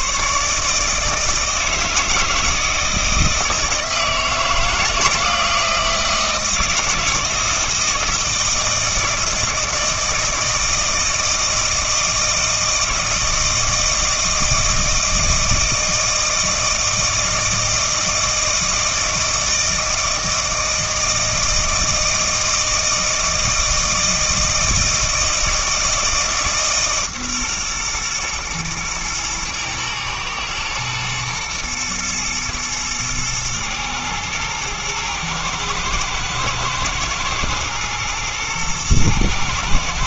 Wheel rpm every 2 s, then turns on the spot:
150, 160, 170, 160, 160, 160, 160, 160, 160, 160, 160, 160, 160, 150, 110, 120, 110, 110, 110, 110.
none